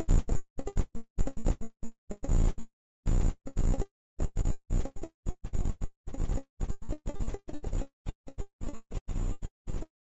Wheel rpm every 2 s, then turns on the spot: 0, 0, 0, 0, 0.
none